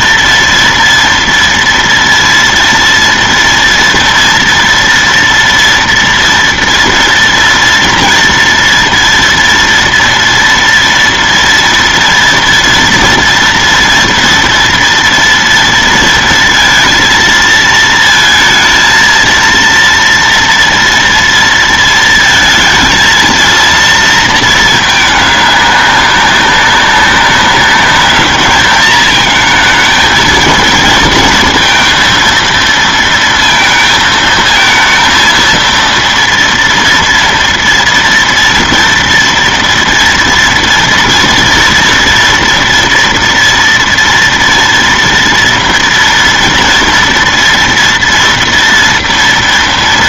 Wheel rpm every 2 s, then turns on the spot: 230, 230, 230, 230, 230, 240, 230, 230, 230, 220, 230, 230, 220, 190, 210, 230, 230, 220, 230, 230, 230, 230, 230, 230, 230.
none